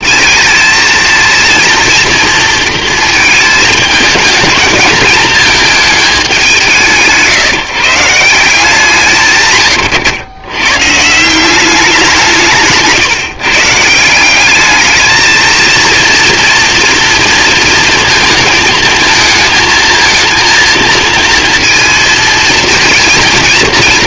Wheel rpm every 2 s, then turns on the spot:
220, 220, 210, 170, 170, 140, 160, 220, 230, 220, 230, 230.
none